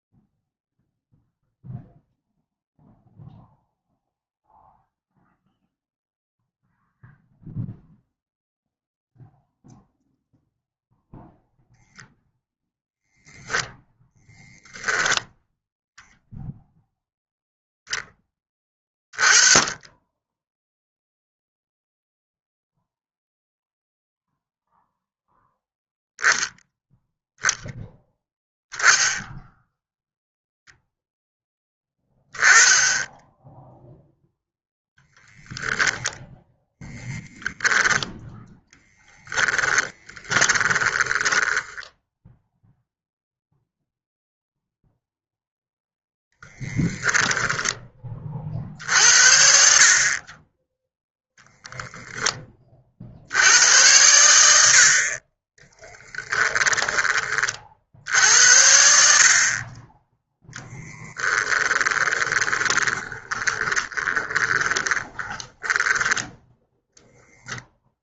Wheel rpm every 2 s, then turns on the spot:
0, 0, 0, 0, 0, 0, 0, 0, 0, 20, 0, 0, 0, 0, 0, 0, 10, 10, 10, 10, 20, 0, 0, 0, 50, 0, 50, 50, 20, 70, 10, 20, 20, 0.
38-42 60-66